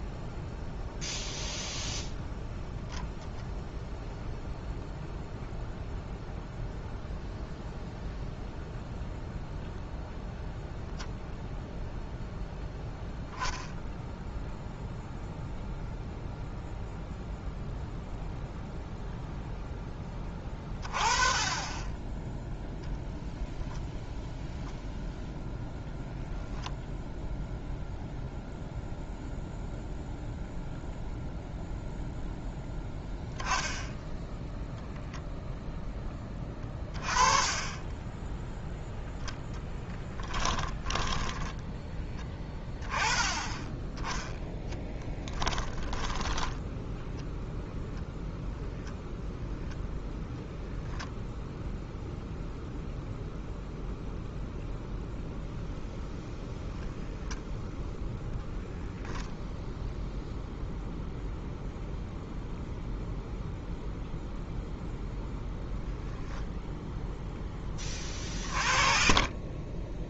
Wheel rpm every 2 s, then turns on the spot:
0, 0, 0, 0, 0, 0, 0, 0, 0, 0, 20, 0, 0, 0, 0, 0, 0, 0, 20, 0, 10, 10, 10, 10, 0, 0, 0, 0, 0, 0, 0, 0, 0, 0, 30.
40-42